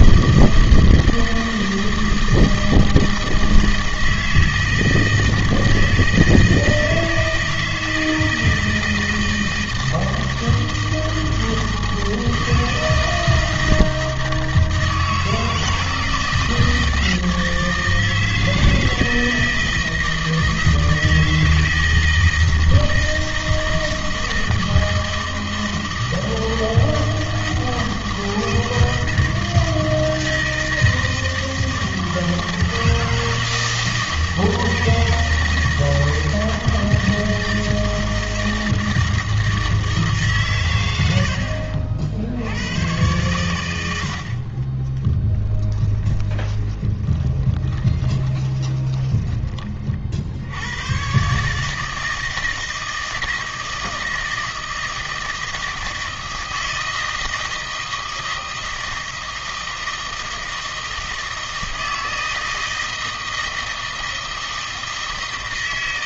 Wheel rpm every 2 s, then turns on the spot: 160, 160, 160, 160, 160, 160, 160, 160, 160, 160, 160, 160, 160, 160, 160, 160, 160, 160, 160, 160, 120, 100, 30, 10, 20, 90, 160, 160, 160, 160, 160, 160, 160.
44-50